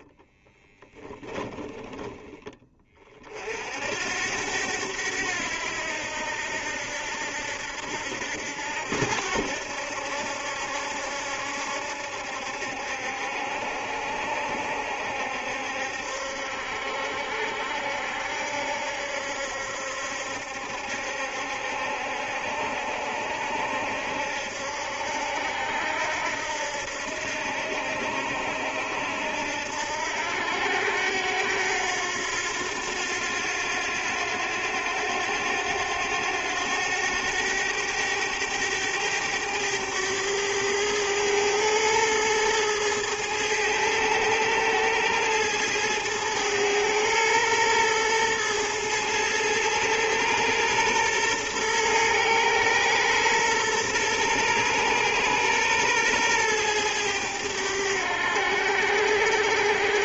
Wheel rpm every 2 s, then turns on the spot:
10, 20, 90, 80, 80, 70, 70, 70, 70, 70, 70, 70, 70, 80, 80, 90, 90, 90, 100, 100, 100, 110, 110, 110, 110, 120, 120, 120, 110, 90.
0-2